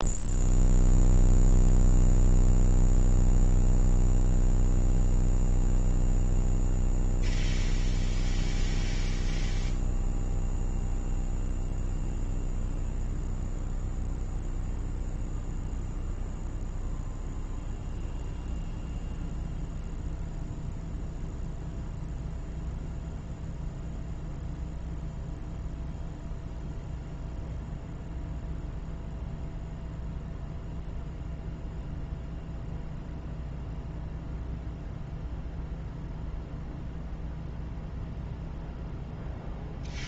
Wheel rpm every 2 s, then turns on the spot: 0, 0, 0, 0, 0, 0, 0, 0, 0, 0, 0, 0, 0, 0, 0, 0, 0, 0, 0, 0.
none